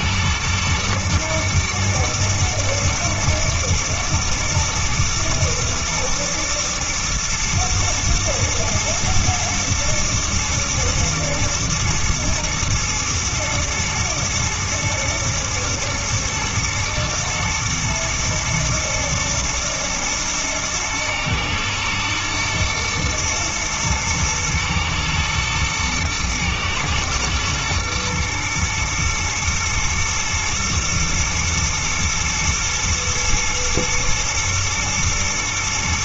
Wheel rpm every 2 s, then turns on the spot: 120, 110, 110, 110, 120, 120, 110, 110, 110, 110, 110, 110, 120, 110, 110, 110, 110, 110.
none